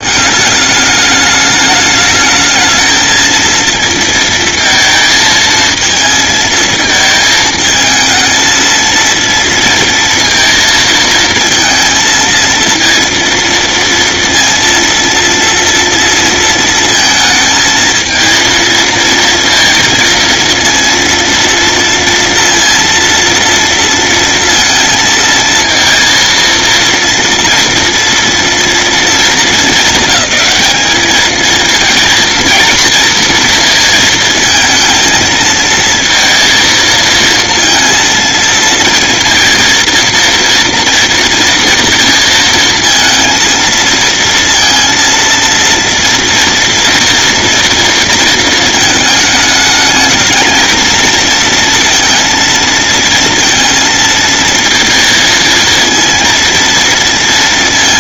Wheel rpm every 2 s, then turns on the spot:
210, 220, 220, 220, 230, 230, 230, 230, 230, 230, 230, 230, 230, 230, 220, 220, 230, 230, 230, 230, 230, 230, 230, 230, 220, 230, 230, 230, 230.
none